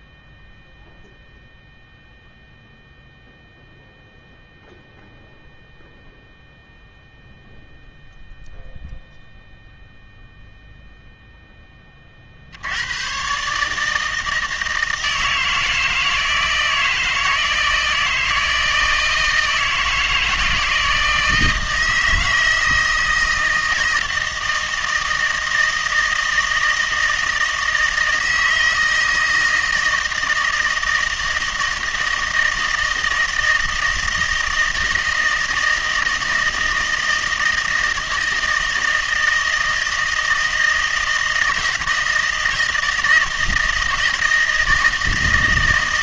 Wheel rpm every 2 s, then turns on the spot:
0, 0, 0, 0, 0, 0, 90, 160, 160, 160, 160, 160, 160, 160, 160, 160, 160, 160, 160, 160, 160, 160, 160.
none